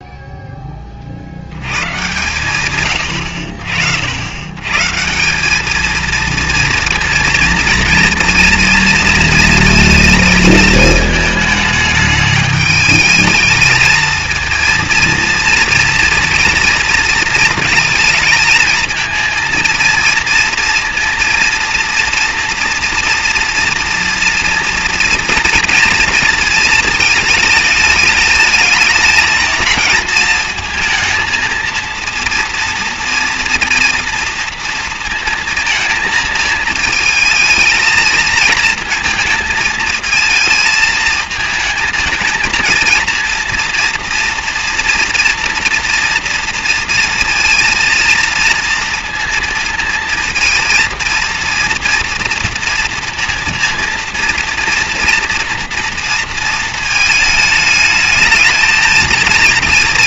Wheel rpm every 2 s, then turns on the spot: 20, 120, 130, 230, 230, 220, 210, 230, 230, 220, 230, 240, 240, 220, 220, 220, 230, 230, 220, 220, 220, 230, 240, 230, 230, 230, 230, 230, 230, 220.
none